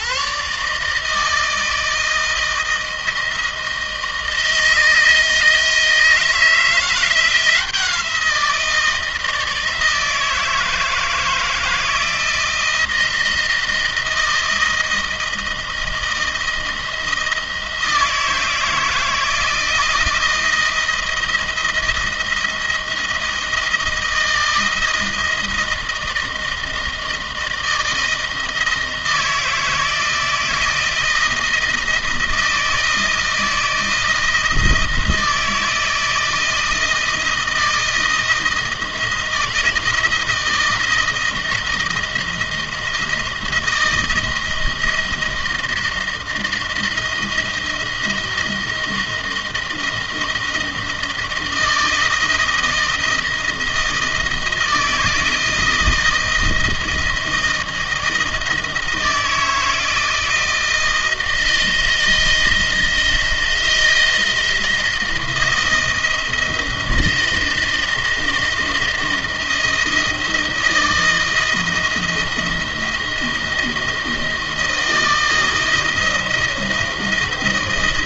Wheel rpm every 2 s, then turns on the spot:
140, 160, 160, 170, 170, 160, 160, 160, 160, 160, 160, 160, 160, 160, 160, 160, 160, 160, 170, 170, 160, 160, 170, 160, 170, 160, 160, 160, 160, 160, 160, 160, 170, 160, 170, 160, 170, 160, 160.
none